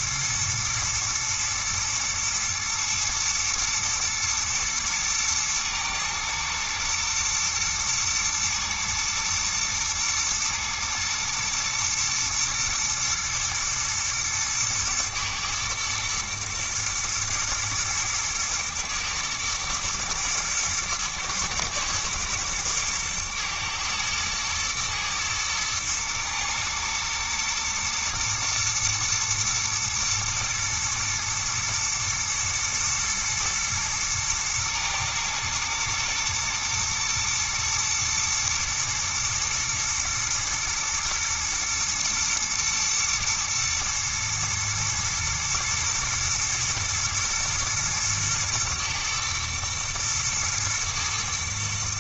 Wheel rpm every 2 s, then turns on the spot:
120, 110, 110, 120, 120, 110, 110, 110, 110, 110, 110, 110, 110, 110, 120, 110, 110, 110, 120, 110, 110, 120, 110, 120, 110, 110.
none